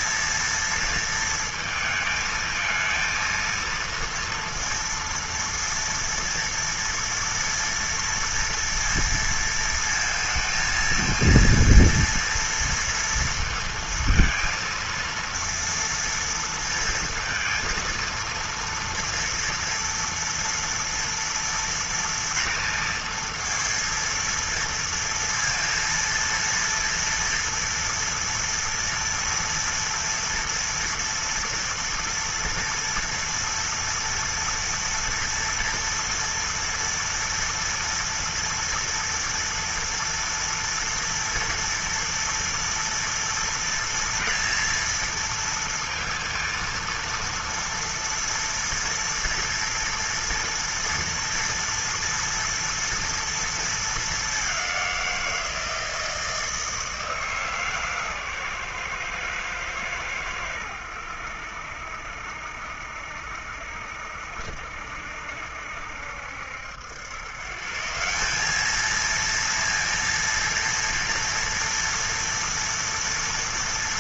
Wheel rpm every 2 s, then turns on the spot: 230, 230, 230, 230, 230, 220, 230, 230, 230, 230, 230, 230, 230, 230, 230, 230, 230, 230, 230, 230, 230, 230, 230, 230, 230, 230, 230, 190, 160, 130, 90, 70, 70, 80, 200, 230, 230.
none